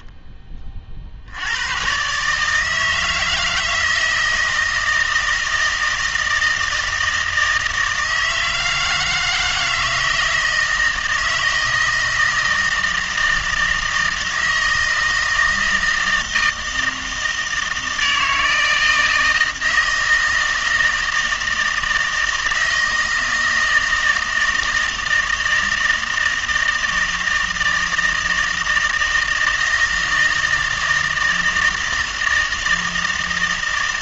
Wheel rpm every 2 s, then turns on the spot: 30, 150, 160, 160, 160, 160, 160, 160, 160, 160, 160, 160, 160, 160, 160, 160, 160.
none